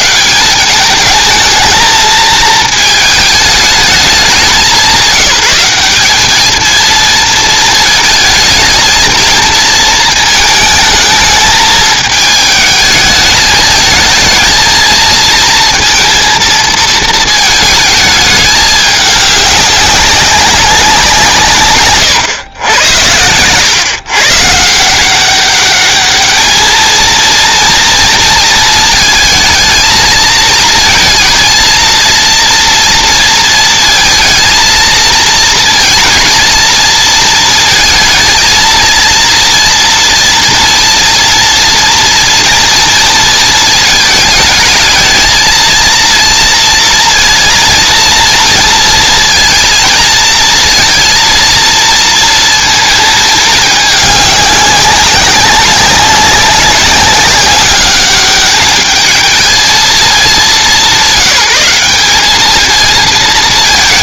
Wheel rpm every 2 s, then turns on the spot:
180, 220, 190, 220, 220, 210, 220, 220, 230, 210, 190, 100, 140, 220, 230, 230, 230, 230, 230, 230, 230, 230, 220, 230, 230, 230, 230, 200, 190, 200, 200, 220.
none